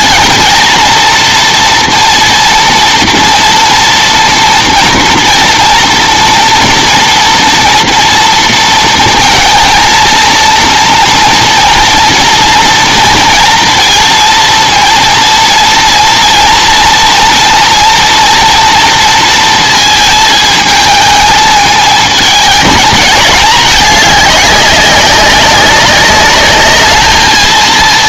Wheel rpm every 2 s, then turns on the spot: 230, 230, 230, 230, 230, 230, 230, 230, 230, 230, 220, 220, 200, 210.
none